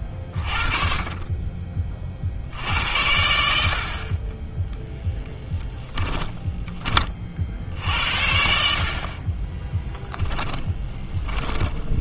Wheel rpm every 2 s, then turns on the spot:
30, 70, 10, 20, 50, 10.
10-12